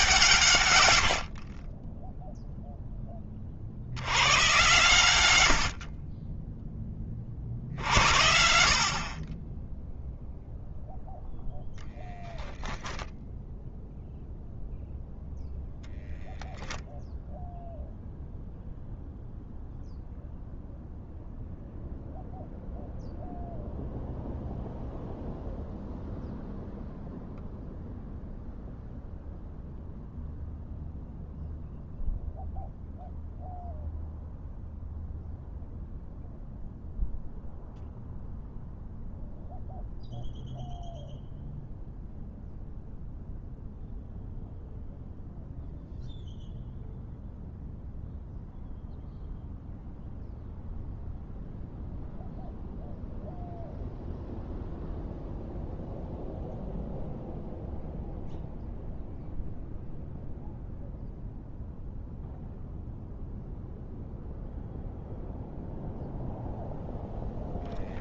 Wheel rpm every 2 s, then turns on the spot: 100, 10, 120, 30, 40, 0, 0, 0, 0, 0, 0, 0, 0, 0, 0, 0, 0, 0, 0, 0, 0, 0, 0, 0, 0, 0, 0, 0, 0, 0, 0, 0, 0, 0.
none